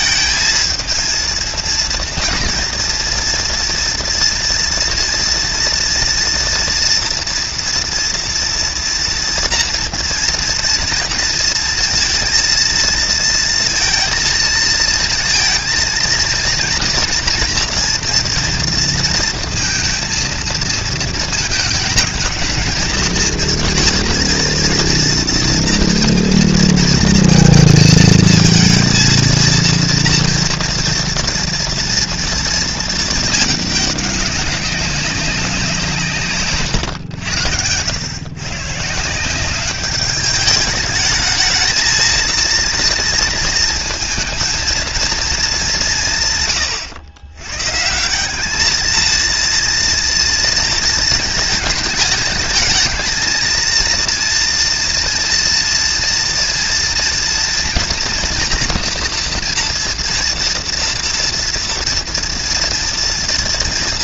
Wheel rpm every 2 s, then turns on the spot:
220, 230, 230, 230, 240, 230, 230, 230, 230, 230, 220, 220, 230, 230, 220, 230, 230, 190, 140, 130, 210, 230, 230, 120, 200, 230, 220, 230, 230, 230, 230, 230.
36-38